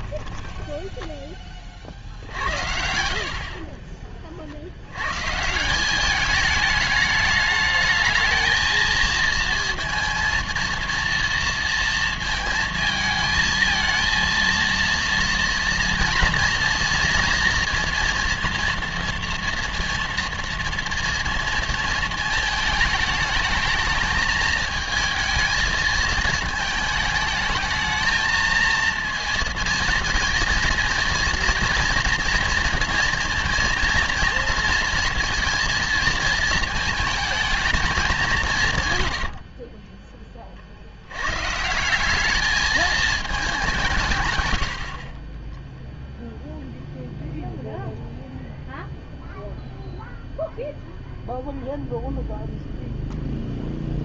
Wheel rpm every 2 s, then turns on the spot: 10, 70, 70, 210, 220, 230, 220, 230, 230, 230, 230, 220, 220, 220, 220, 230, 230, 230, 220, 180, 40, 210, 90, 0, 0, 0, 0.
0-2 44-46